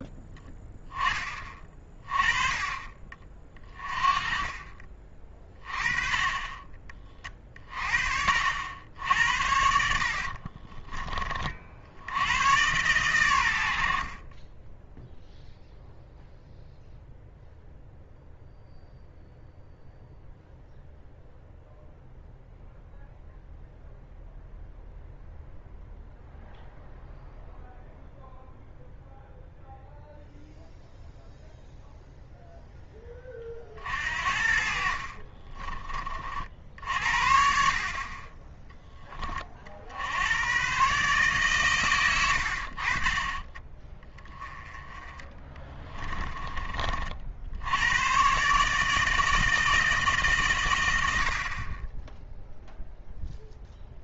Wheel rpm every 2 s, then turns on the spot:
10, 30, 30, 30, 70, 40, 110, 20, 0, 0, 0, 0, 0, 0, 0, 0, 0, 50, 50, 10, 120, 50, 20, 30, 140, 120, 0.
4-6 10-12